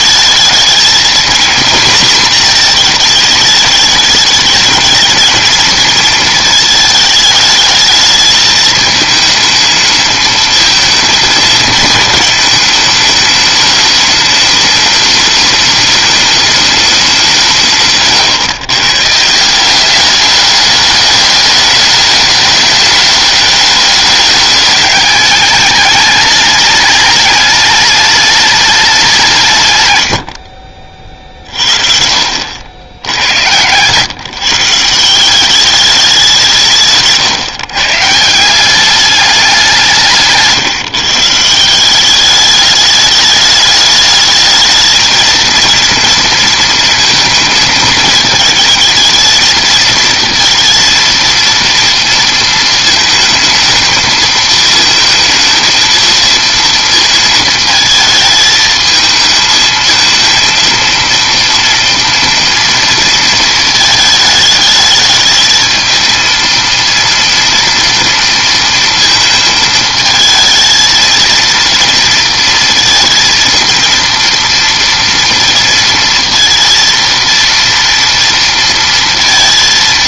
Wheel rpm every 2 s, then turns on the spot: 220, 230, 220, 220, 220, 220, 220, 210, 210, 140, 210, 210, 210, 210, 210, 60, 80, 160, 160, 170, 160, 210, 220, 230, 220, 230, 230, 220, 230, 220, 230, 230, 220, 230, 230, 220, 230, 230, 230, 230.
none